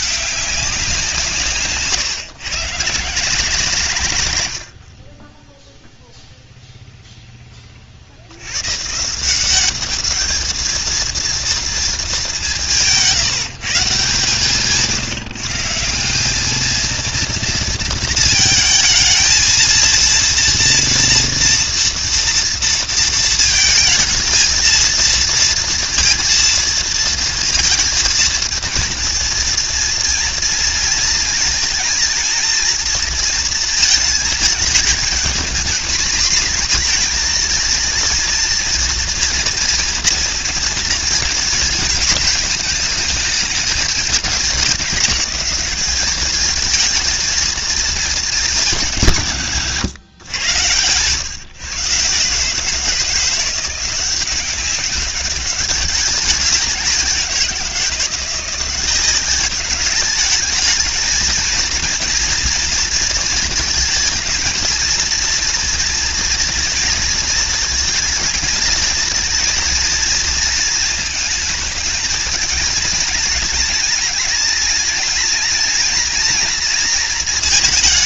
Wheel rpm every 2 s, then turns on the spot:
170, 140, 60, 0, 140, 230, 170, 150, 220, 220, 230, 230, 230, 230, 230, 230, 230, 220, 240, 230, 230, 210, 200, 220, 170, 120, 160, 200, 180, 180, 230, 230, 230, 230, 220, 230, 220, 220, 230.
none